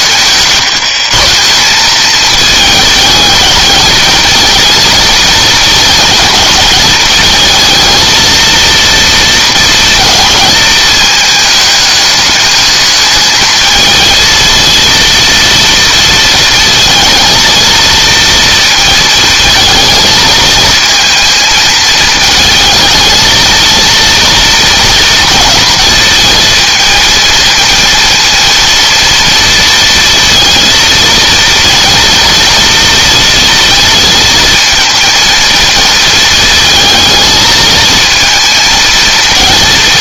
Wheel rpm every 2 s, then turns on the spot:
150, 220, 220, 220, 230, 220, 210, 230, 230, 220, 220, 220, 230, 230, 230, 230, 230, 230, 220, 230.
none